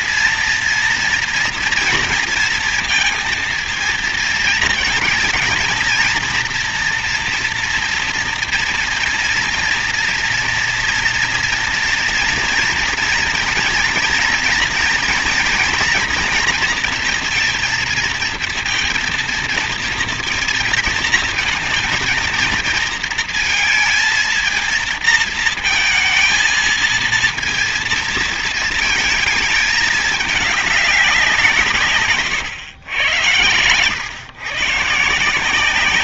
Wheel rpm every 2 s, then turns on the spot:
230, 230, 230, 240, 240, 230, 230, 230, 240, 230, 230, 230, 230, 230, 230, 200, 120, 140.
none